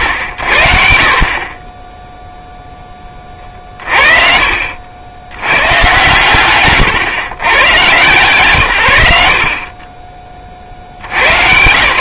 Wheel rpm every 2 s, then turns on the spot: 80, 0, 60, 130, 110, 60.
none